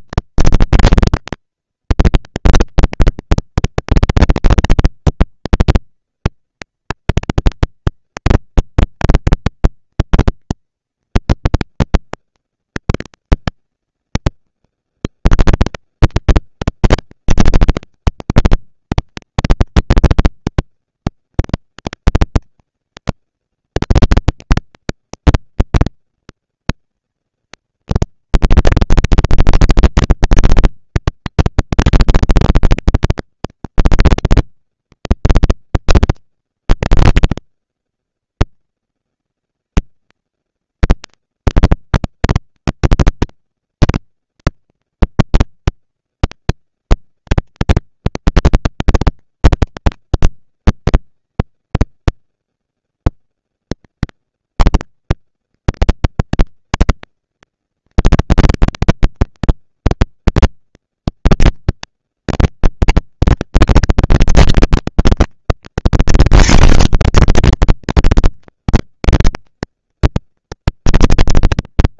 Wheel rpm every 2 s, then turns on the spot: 230, 230, 230, 230, 230, 230, 230, 220, 200, 220, 230, 220, 230, 230, 230, 230, 230, 230, 230, 230, 230, 230, 240, 230, 210, 200, 200, 230, 220, 230, 230, 230, 230, 250, 240, 230.
none